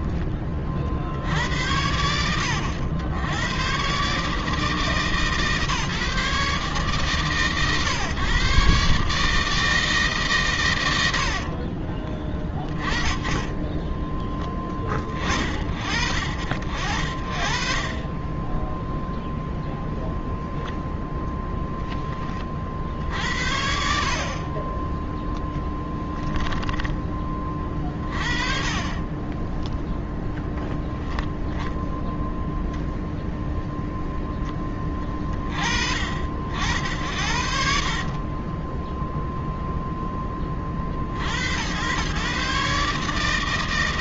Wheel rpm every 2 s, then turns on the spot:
40, 100, 140, 130, 150, 70, 10, 50, 60, 0, 10, 70, 10, 30, 20, 0, 10, 30, 70, 0, 80, 150.
10-12 16-18 24-26 28-30 36-38